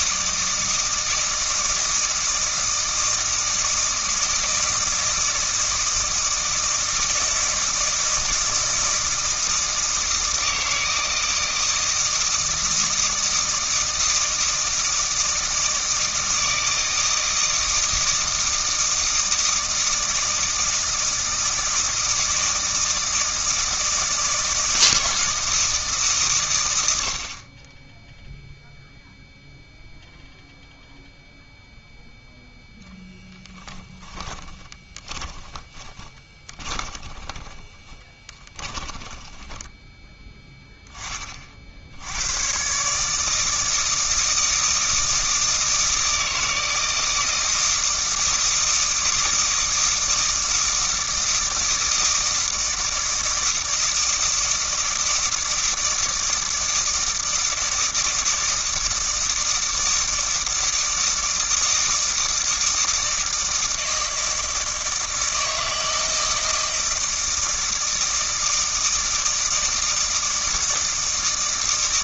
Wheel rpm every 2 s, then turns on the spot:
160, 160, 160, 160, 160, 160, 160, 160, 160, 160, 160, 160, 160, 110, 0, 0, 0, 20, 20, 20, 10, 110, 160, 160, 160, 160, 160, 160, 160, 160, 160, 160, 160, 160, 160, 160.
34-40